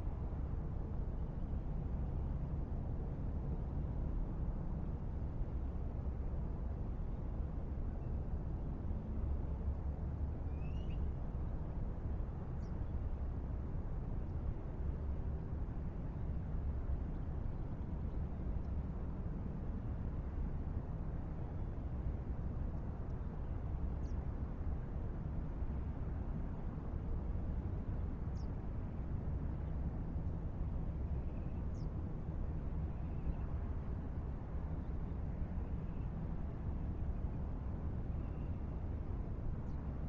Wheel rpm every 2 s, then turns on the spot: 0, 0, 0, 0, 0, 0, 0, 0, 0, 0, 0, 0, 0, 0, 0, 0, 0, 0, 0, 0.
none